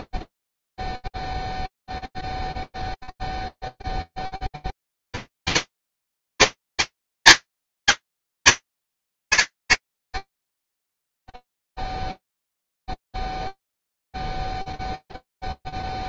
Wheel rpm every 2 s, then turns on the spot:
0, 0, 20, 220, 110, 0, 0, 0.
none